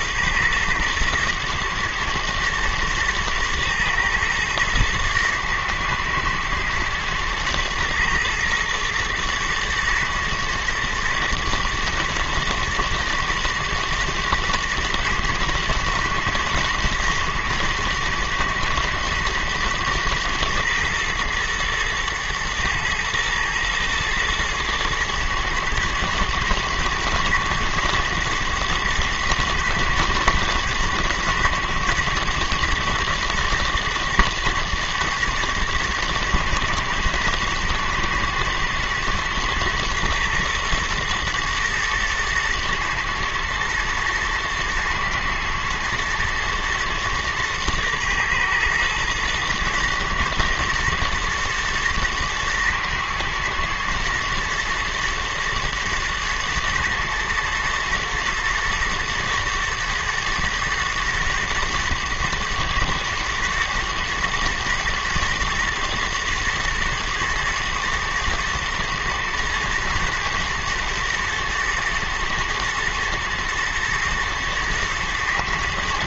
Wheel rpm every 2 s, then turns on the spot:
120, 110, 110, 110, 120, 120, 110, 110, 120, 120, 110, 110, 110, 110, 110, 120, 110, 120, 110, 110, 110, 120, 120, 110, 110, 120, 110, 120, 110, 110, 120, 110, 120, 110, 110, 120, 110, 120.
none